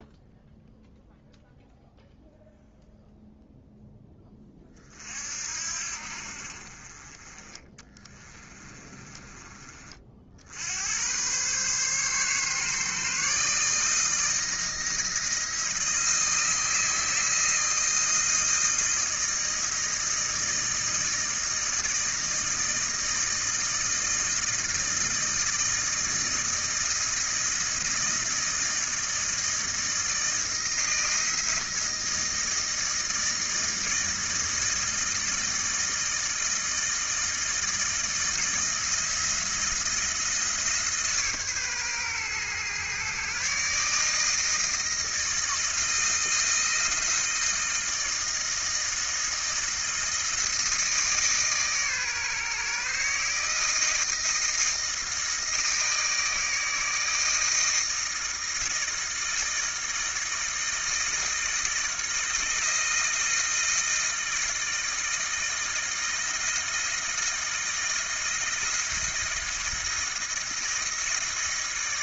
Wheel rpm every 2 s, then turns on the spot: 0, 0, 10, 50, 20, 50, 140, 160, 160, 160, 160, 160, 160, 160, 170, 160, 160, 160, 160, 160, 170, 130, 160, 160, 160, 160, 150, 160, 160, 160, 160, 160, 160, 160, 170, 170.
8-10